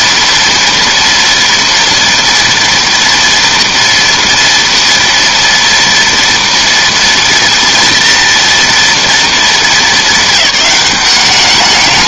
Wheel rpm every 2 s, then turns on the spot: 230, 230, 230, 230, 230, 180.
none